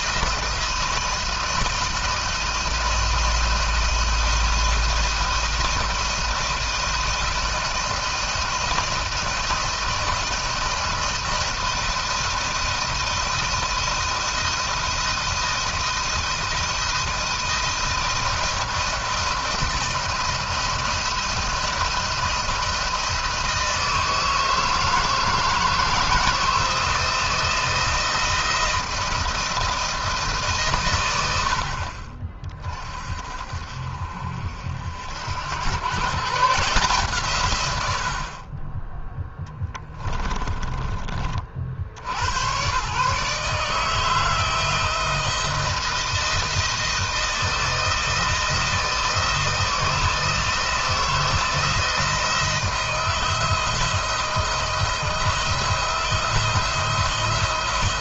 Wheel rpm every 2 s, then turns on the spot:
160, 160, 160, 170, 160, 160, 170, 160, 160, 160, 170, 170, 160, 160, 160, 110, 40, 70, 160, 30, 30, 110, 160, 160, 160, 160, 160, 170, 170.
40-42